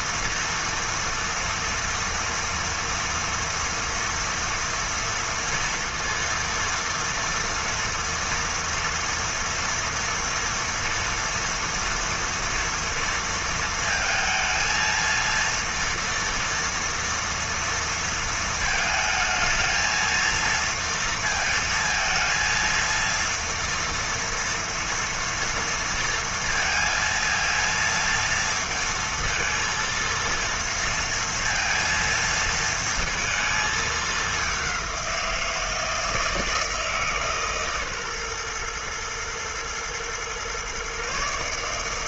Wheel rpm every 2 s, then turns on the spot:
230, 230, 230, 230, 230, 230, 230, 230, 230, 220, 230, 230, 230, 230, 230, 230, 230, 190, 160, 120, 130.
none